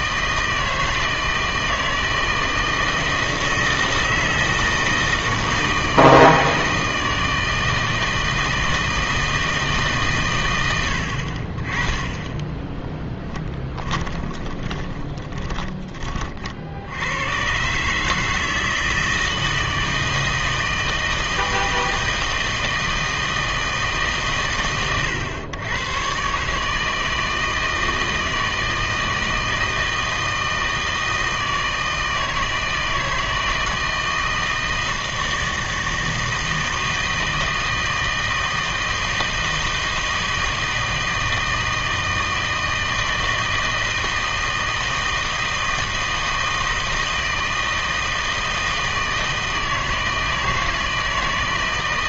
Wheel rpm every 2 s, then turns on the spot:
160, 160, 160, 160, 160, 90, 10, 20, 80, 160, 160, 160, 120, 150, 160, 160, 160, 160, 160, 160, 160, 160, 160, 160, 160, 160.
12-16